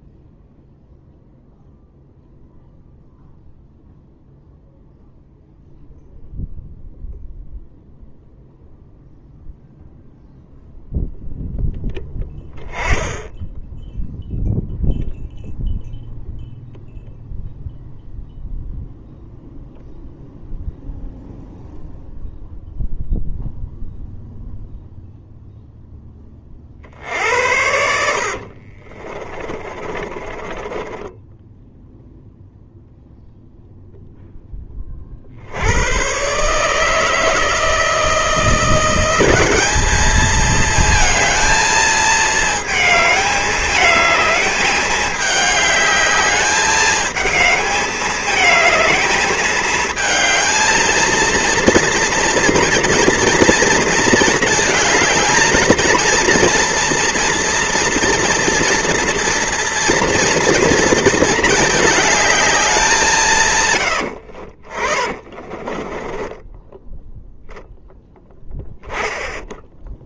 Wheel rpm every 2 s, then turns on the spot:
0, 0, 0, 0, 0, 0, 10, 0, 0, 0, 0, 0, 0, 60, 40, 20, 0, 30, 160, 180, 220, 220, 210, 210, 220, 230, 230, 220, 230, 230, 230, 190, 40, 10, 0.
28-32 64-68